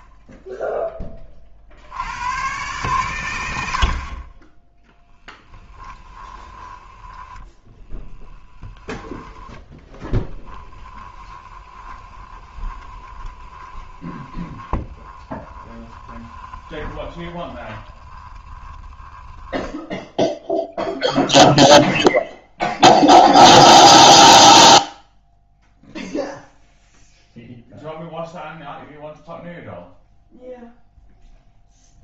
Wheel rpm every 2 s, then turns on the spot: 10, 120, 10, 20, 30, 10, 20, 20, 20, 10, 0, 0, 0, 0, 0, 0.
8-18